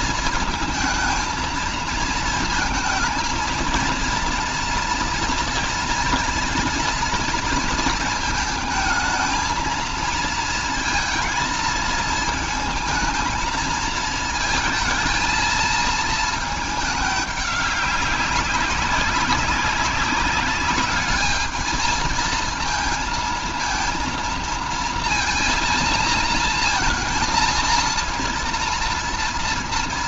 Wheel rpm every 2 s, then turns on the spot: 230, 230, 230, 230, 220, 230, 220, 230, 210, 190, 200, 220, 230, 230, 230.
none